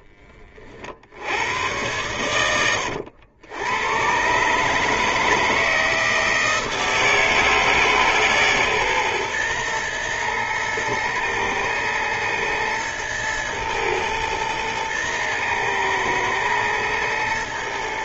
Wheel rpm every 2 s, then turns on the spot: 50, 90, 140, 160, 140, 120, 110, 110, 110.
2-4